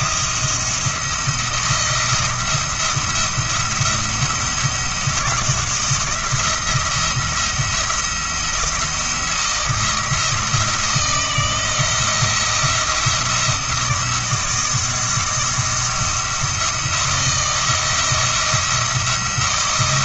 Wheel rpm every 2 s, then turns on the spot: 170, 170, 170, 170, 170, 160, 170, 170, 170, 170.
none